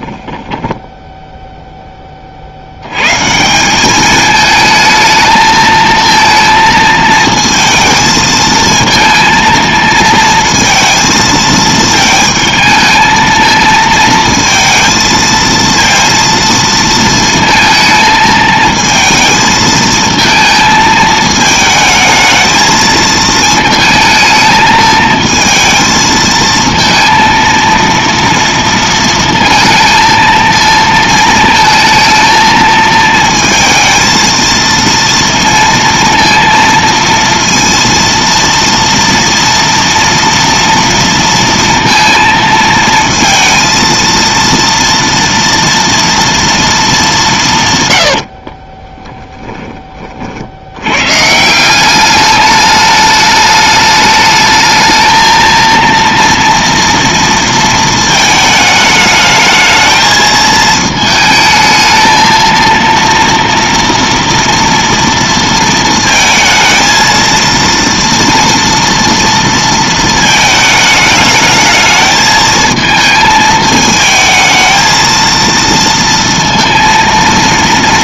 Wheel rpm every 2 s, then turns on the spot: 10, 90, 220, 220, 220, 230, 220, 230, 230, 220, 220, 220, 220, 230, 230, 230, 220, 230, 230, 230, 230, 230, 230, 220, 30, 90, 210, 220, 230, 210, 220, 230, 230, 230, 230, 220, 220, 220, 230.
0-2 48-50